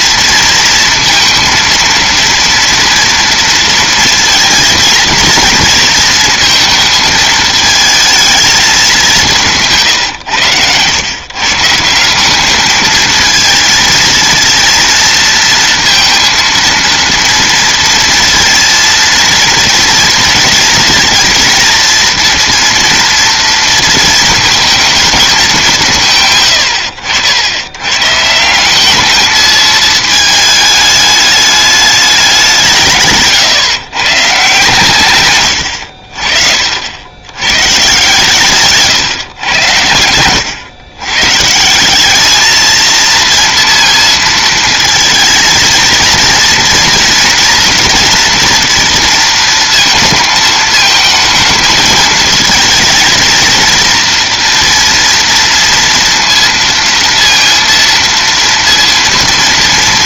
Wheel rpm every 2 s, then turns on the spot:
230, 230, 230, 230, 200, 100, 210, 230, 230, 230, 230, 230, 230, 100, 190, 220, 170, 130, 50, 150, 120, 220, 230, 230, 230, 220, 220, 230, 230, 230.
none